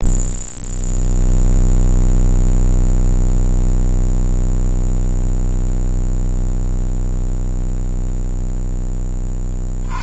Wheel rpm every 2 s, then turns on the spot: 0, 0, 0, 0, 0.
none